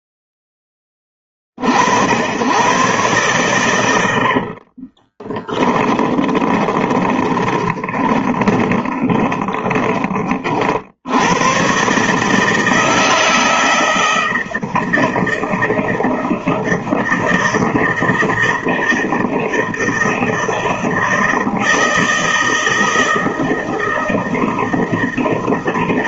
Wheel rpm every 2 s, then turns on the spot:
0, 100, 60, 10, 20, 60, 150, 160, 160, 160, 160, 160, 160.
4-10